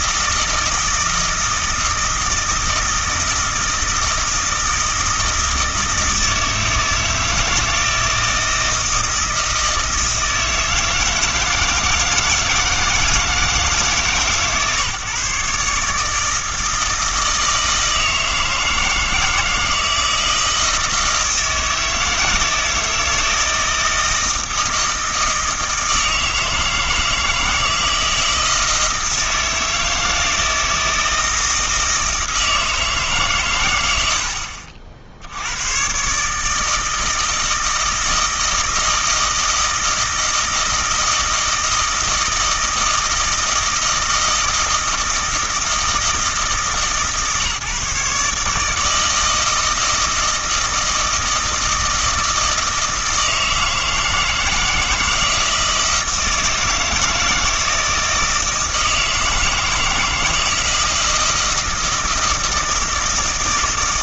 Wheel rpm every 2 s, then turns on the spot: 160, 160, 160, 160, 160, 160, 160, 140, 160, 160, 160, 160, 160, 160, 160, 160, 160, 60, 160, 160, 160, 160, 160, 150, 160, 160, 160, 160, 160, 160, 160, 160.
none